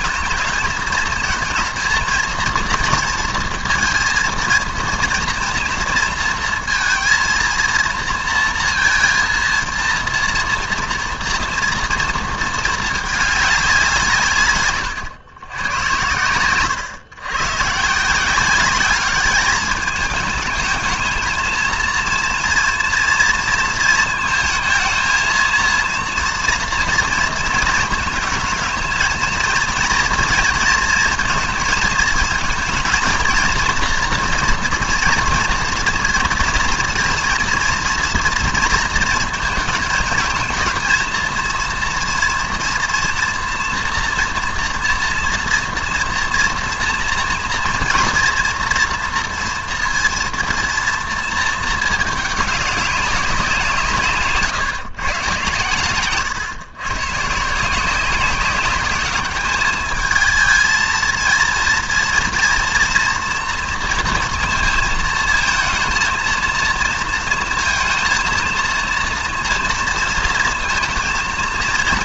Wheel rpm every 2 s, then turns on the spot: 220, 230, 230, 230, 230, 230, 220, 130, 110, 200, 220, 230, 220, 230, 230, 230, 230, 240, 230, 230, 230, 230, 230, 230, 230, 230, 200, 140, 120, 190, 220, 230, 230, 230, 230, 230.
none